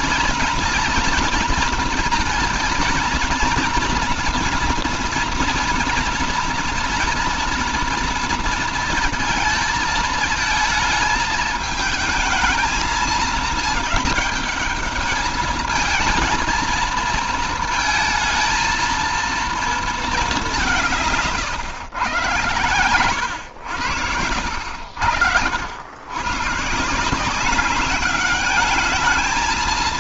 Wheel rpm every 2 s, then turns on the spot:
240, 230, 240, 230, 230, 220, 220, 210, 220, 230, 190, 110, 80, 130, 210.
none